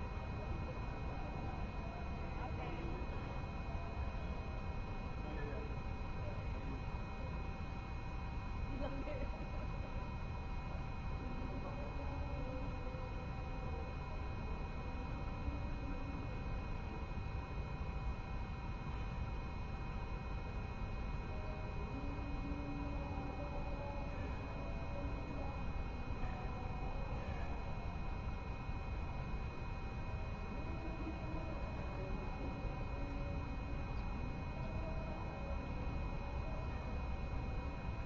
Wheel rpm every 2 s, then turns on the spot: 0, 0, 0, 0, 0, 0, 0, 0, 0, 0, 0, 0, 0, 0, 0, 0, 0, 0, 0.
none